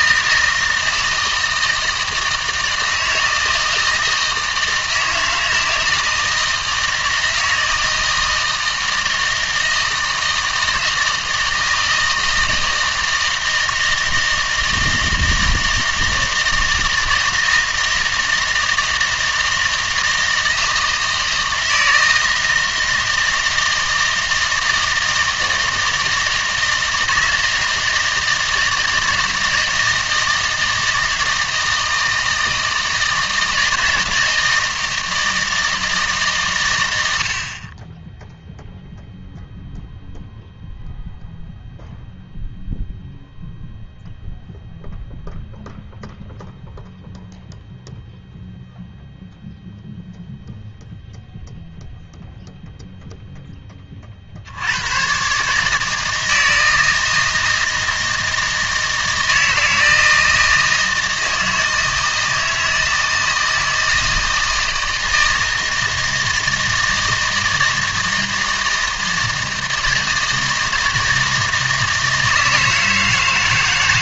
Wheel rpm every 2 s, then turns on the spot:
160, 160, 160, 160, 160, 160, 160, 160, 160, 160, 160, 160, 160, 160, 160, 160, 160, 160, 110, 0, 0, 0, 0, 0, 0, 0, 0, 80, 160, 160, 160, 160, 160, 160, 160, 160, 160.
none